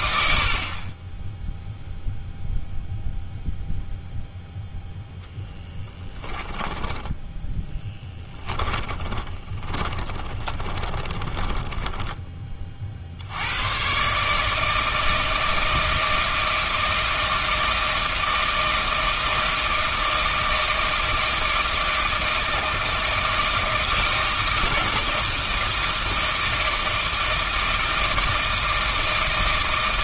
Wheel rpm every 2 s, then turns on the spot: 50, 0, 0, 20, 10, 20, 30, 160, 160, 160, 160, 170, 160, 160, 160.
6-12